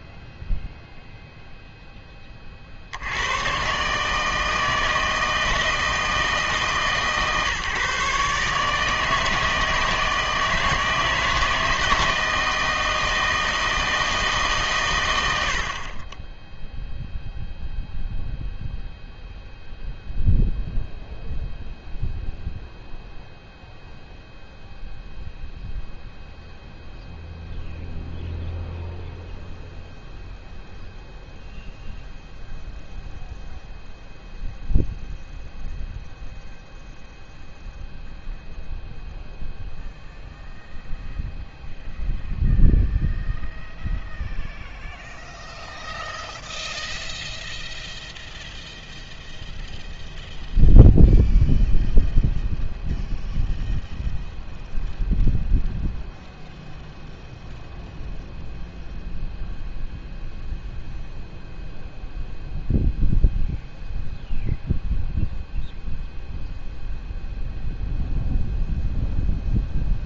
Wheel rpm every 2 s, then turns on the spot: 0, 50, 160, 150, 160, 160, 160, 130, 0, 0, 0, 0, 0, 0, 0, 0, 0, 0, 0, 0, 0, 0, 0, 0, 0, 0, 0, 0, 0, 0, 0, 0, 0, 0, 0.
none